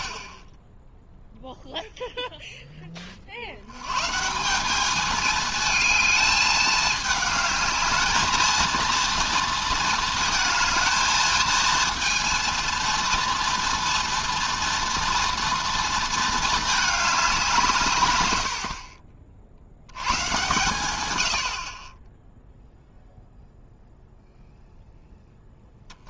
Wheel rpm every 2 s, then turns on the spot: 20, 20, 200, 220, 230, 220, 230, 230, 220, 60, 130, 0, 0.
none